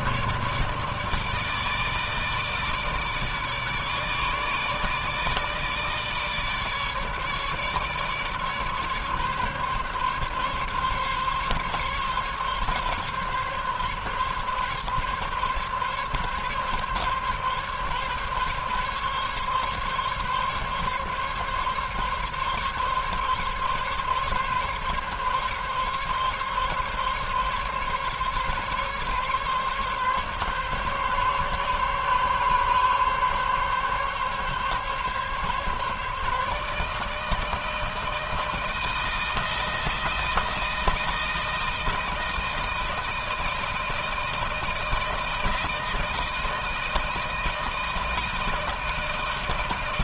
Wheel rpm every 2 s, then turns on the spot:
150, 150, 150, 150, 140, 140, 140, 140, 140, 140, 140, 140, 140, 140, 140, 140, 140, 140, 160, 160, 160, 160, 160, 160, 160.
none